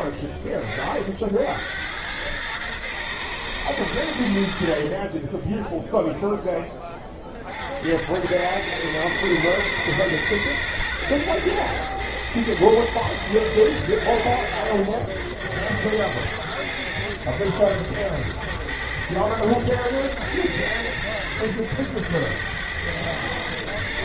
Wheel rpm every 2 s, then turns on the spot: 30, 110, 70, 10, 100, 110, 110, 80, 100, 90, 110, 110.
none